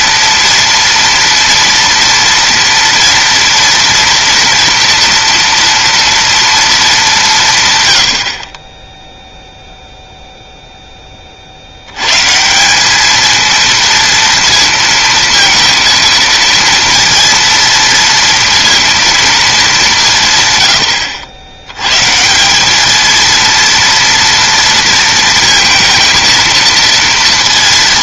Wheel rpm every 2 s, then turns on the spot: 230, 230, 230, 220, 20, 0, 180, 230, 230, 230, 130, 190, 230, 230.
none